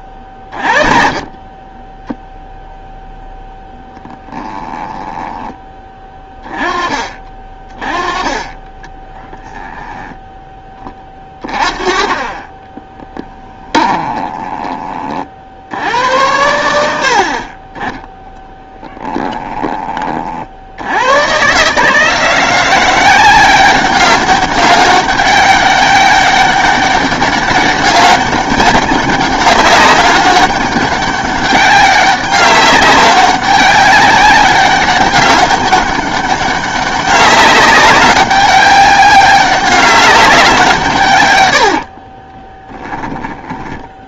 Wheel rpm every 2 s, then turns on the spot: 40, 0, 10, 20, 20, 20, 20, 30, 80, 10, 90, 180, 200, 200, 200, 200, 200, 190, 200, 200, 150, 10.
4-6 12-14 18-20